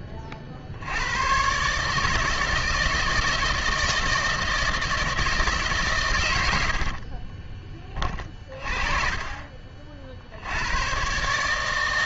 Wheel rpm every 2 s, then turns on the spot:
60, 160, 160, 90, 20, 80.
6-8